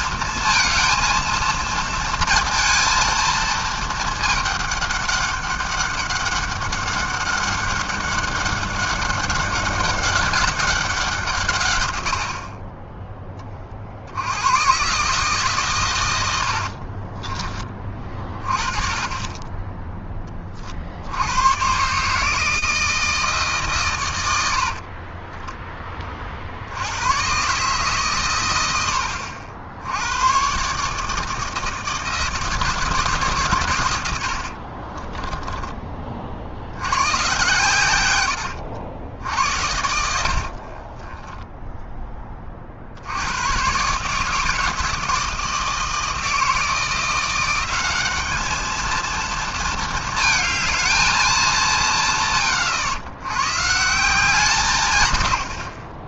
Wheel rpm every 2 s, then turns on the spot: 230, 230, 210, 200, 200, 190, 50, 100, 70, 30, 30, 160, 70, 60, 100, 120, 160, 60, 60, 80, 60, 30, 160, 160, 210, 220, 120, 160.
12-14 16-18 34-36 38-42